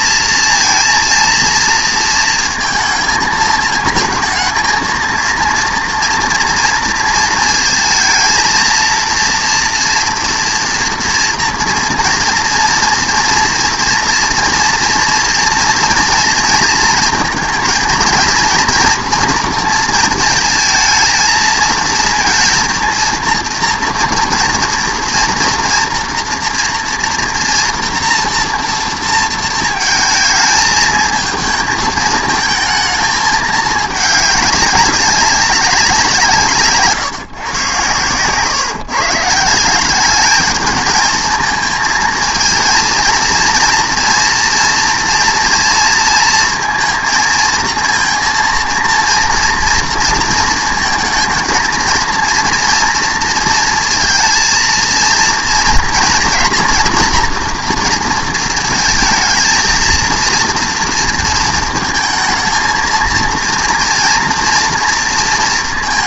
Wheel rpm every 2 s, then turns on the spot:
230, 220, 220, 230, 230, 230, 230, 230, 230, 230, 220, 230, 230, 230, 230, 220, 220, 200, 150, 140, 210, 230, 230, 230, 230, 230, 240, 230, 230, 230, 230, 220, 230.
none